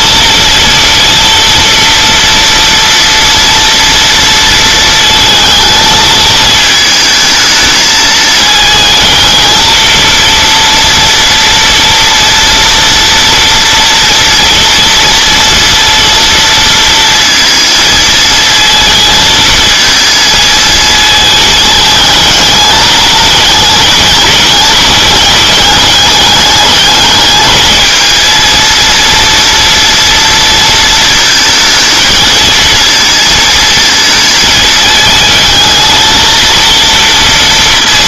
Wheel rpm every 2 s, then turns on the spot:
230, 230, 230, 220, 220, 230, 230, 230, 230, 220, 220, 210, 210, 210, 230, 230, 230, 220, 230.
none